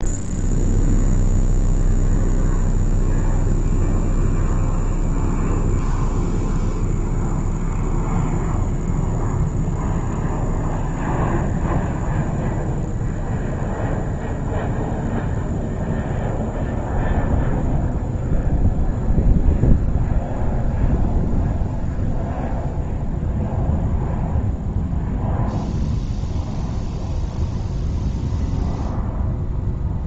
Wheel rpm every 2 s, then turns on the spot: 0, 0, 0, 0, 0, 0, 0, 0, 0, 0, 0, 0, 0, 0, 0.
none